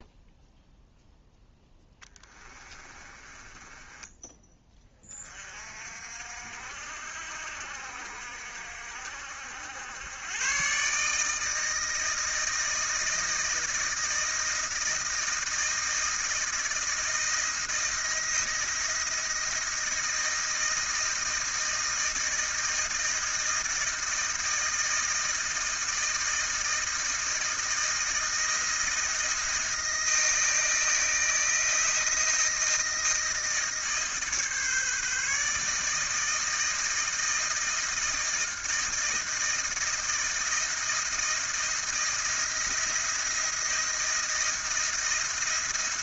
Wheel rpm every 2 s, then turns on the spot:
0, 20, 20, 60, 60, 130, 160, 160, 160, 170, 160, 160, 160, 160, 170, 160, 160, 150, 160, 160, 160, 170, 170.
2-4